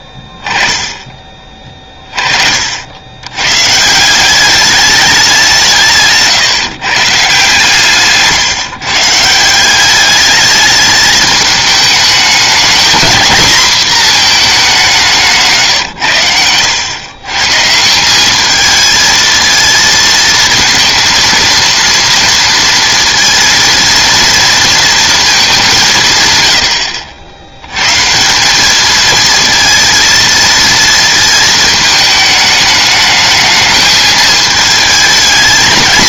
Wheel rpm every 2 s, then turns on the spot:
10, 50, 200, 140, 150, 210, 220, 220, 100, 210, 220, 230, 230, 100, 200, 230, 210, 220.
none